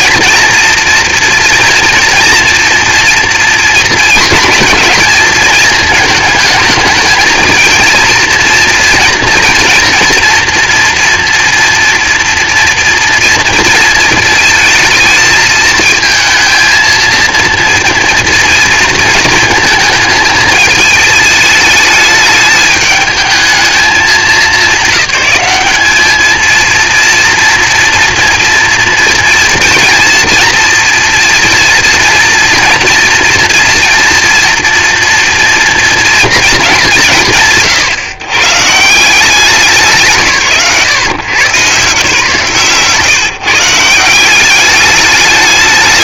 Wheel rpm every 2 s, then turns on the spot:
230, 230, 220, 220, 230, 230, 230, 220, 230, 230, 210, 210, 210, 230, 230, 230, 240, 230, 200, 160, 150, 140, 200.
42-44